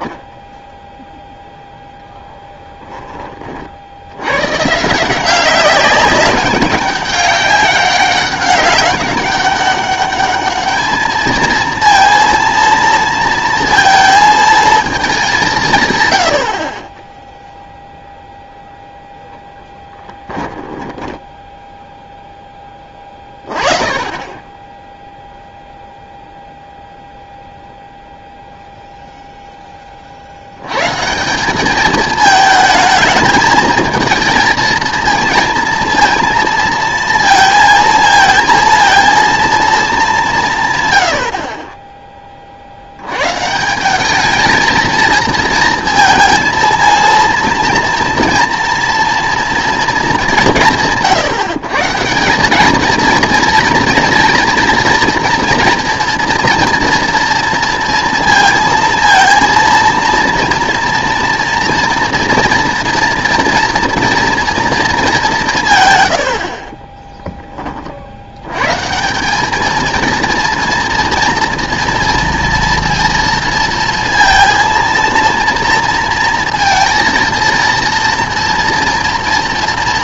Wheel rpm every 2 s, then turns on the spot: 0, 10, 150, 190, 200, 210, 230, 220, 30, 0, 10, 20, 0, 0, 0, 120, 220, 230, 230, 230, 150, 60, 220, 230, 230, 170, 210, 230, 230, 230, 230, 230, 230, 30, 140, 230, 230, 230, 230, 230.
20-22